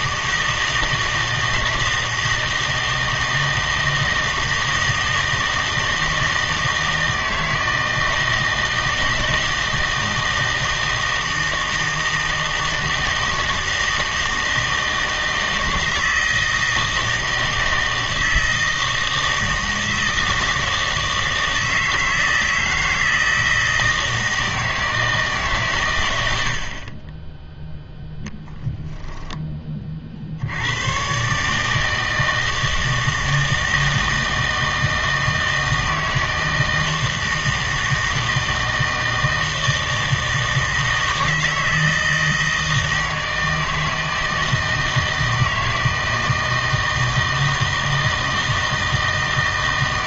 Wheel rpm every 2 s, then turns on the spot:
160, 160, 160, 160, 160, 160, 160, 160, 160, 160, 160, 160, 160, 60, 10, 100, 160, 160, 160, 160, 160, 160, 160, 160, 160.
28-30